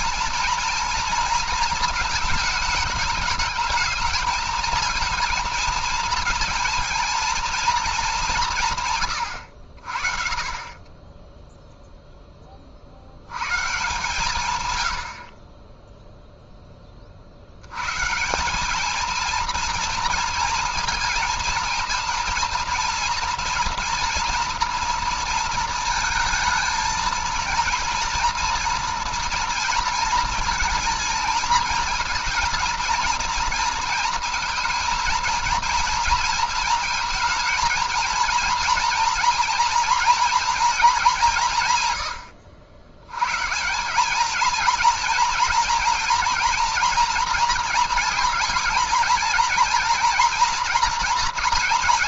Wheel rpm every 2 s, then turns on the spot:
240, 220, 220, 230, 140, 30, 40, 120, 10, 200, 230, 230, 230, 220, 230, 230, 240, 230, 230, 230, 220, 90, 230, 230, 230, 230.
none